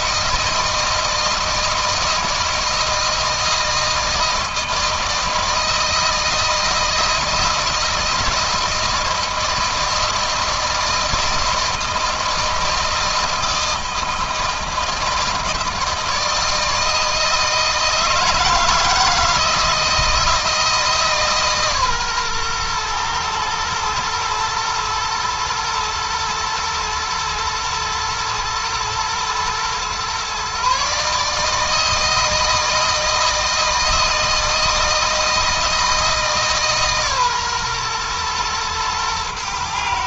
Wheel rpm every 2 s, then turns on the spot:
160, 160, 160, 160, 160, 160, 160, 160, 160, 160, 160, 120, 120, 120, 120, 140, 160, 160, 140, 110.
none